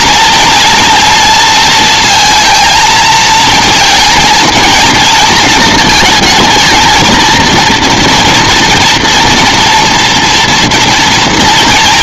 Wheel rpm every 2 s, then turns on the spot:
230, 230, 230, 220, 240, 240.
none